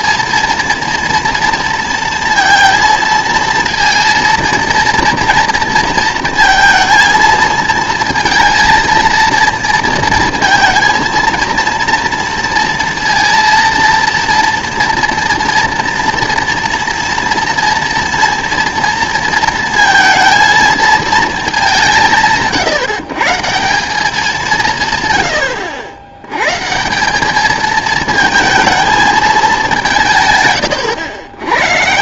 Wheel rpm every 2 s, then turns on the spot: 230, 230, 230, 230, 230, 230, 230, 230, 230, 230, 220, 160, 170, 140, 220, 120.
none